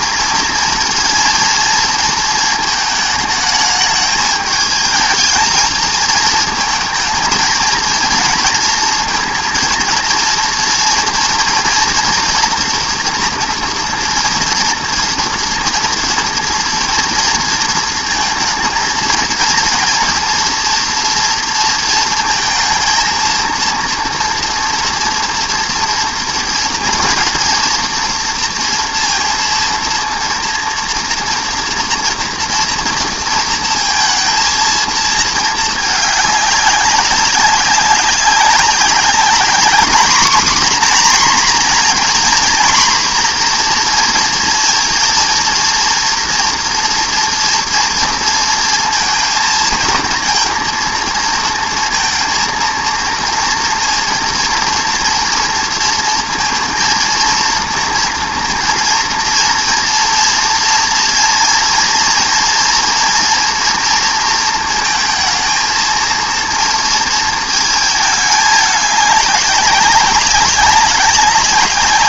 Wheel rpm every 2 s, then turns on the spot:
230, 220, 220, 220, 230, 230, 240, 230, 230, 220, 230, 230, 230, 230, 230, 240, 230, 220, 200, 190, 250, 240, 230, 240, 220, 220, 230, 230, 230, 230, 230, 230, 220, 230, 210, 200.
none